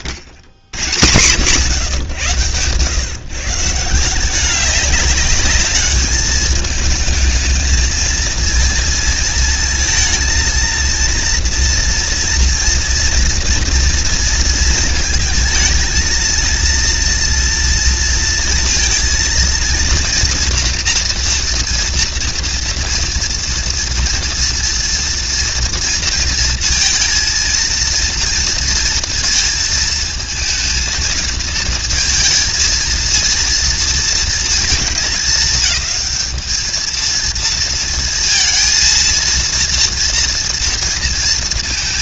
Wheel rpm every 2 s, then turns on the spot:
80, 130, 200, 210, 230, 230, 240, 220, 230, 230, 230, 230, 230, 230, 230, 220, 230, 220, 220, 230, 230.
none